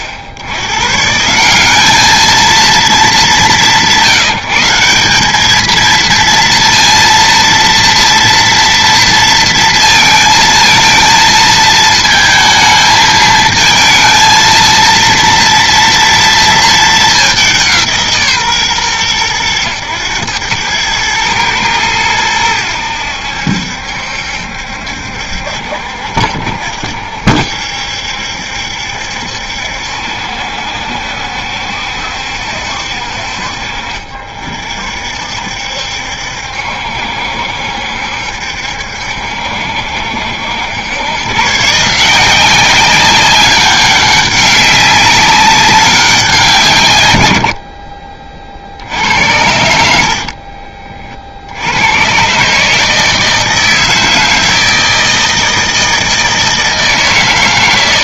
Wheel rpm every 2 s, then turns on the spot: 100, 230, 170, 230, 230, 230, 220, 230, 220, 150, 110, 100, 70, 70, 70, 70, 60, 50, 70, 70, 80, 190, 190, 160, 90, 50, 150, 160, 160.
50-52